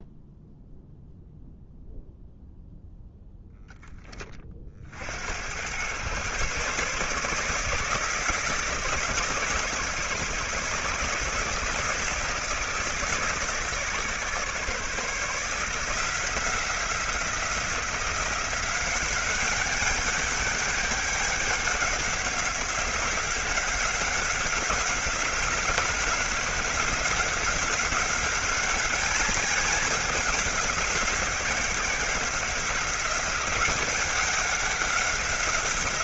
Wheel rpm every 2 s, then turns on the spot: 0, 0, 60, 140, 160, 160, 160, 150, 170, 190, 200, 190, 190, 190, 200, 180, 180, 180.
none